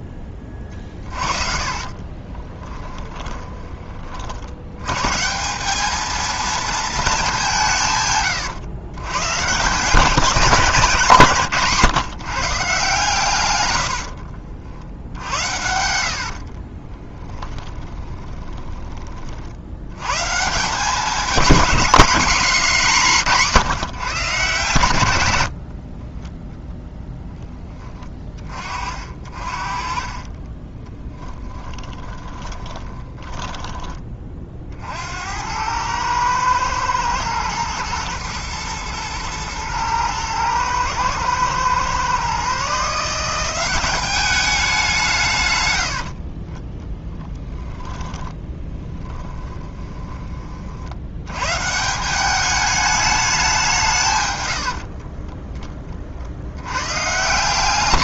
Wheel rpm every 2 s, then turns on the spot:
40, 20, 120, 220, 130, 180, 140, 70, 20, 30, 200, 200, 110, 10, 40, 20, 20, 60, 110, 110, 120, 150, 180, 10, 10, 60, 210, 60, 110.
0-4 10-12 16-18 22-26 30-34 46-50 54-56